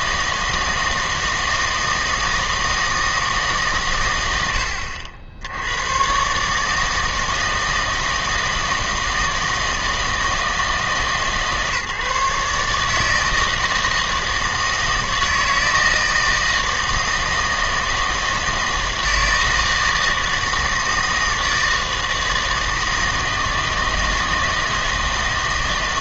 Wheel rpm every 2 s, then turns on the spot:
160, 160, 90, 150, 160, 160, 150, 160, 160, 160, 160, 160, 160.
none